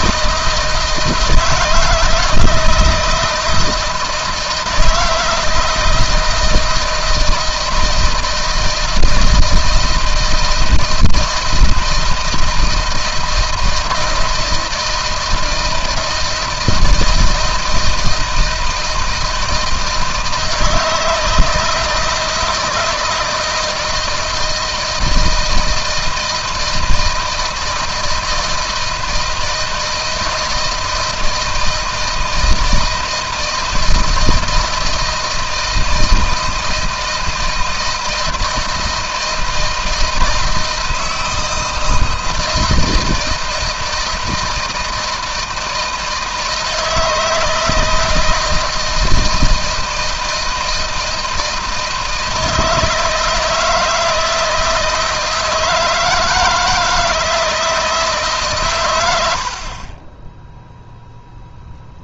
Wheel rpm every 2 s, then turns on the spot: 160, 160, 160, 160, 160, 160, 160, 160, 160, 160, 160, 160, 160, 170, 160, 160, 160, 170, 160, 160, 160, 160, 160, 160, 170, 160, 160, 160, 160, 130, 0.
none